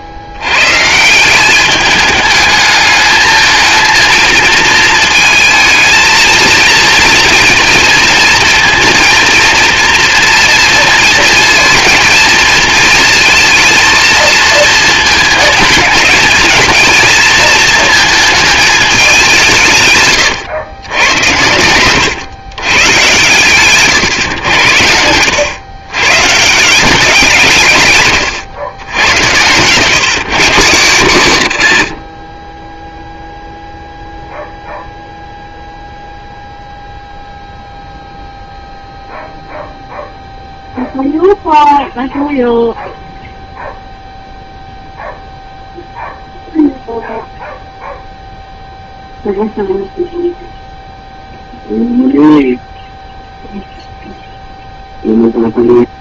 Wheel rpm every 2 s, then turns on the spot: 140, 210, 220, 220, 230, 230, 220, 220, 220, 220, 120, 130, 90, 180, 100, 150, 10, 0, 0, 0, 0, 0, 0, 0, 0, 0, 0, 0.
32-34